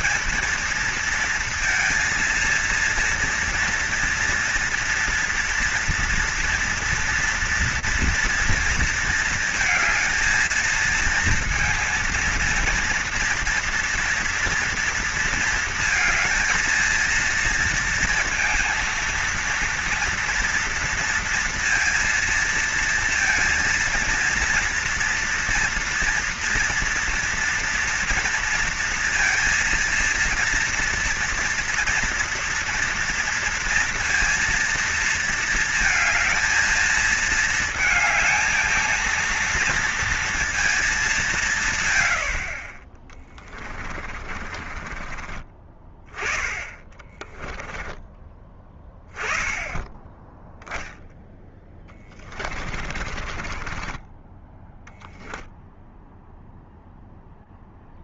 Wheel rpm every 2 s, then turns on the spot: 220, 230, 230, 230, 230, 220, 230, 230, 220, 230, 230, 230, 230, 230, 230, 240, 240, 230, 220, 220, 220, 50, 40, 20, 10, 10, 30, 10, 0.
44-48 52-54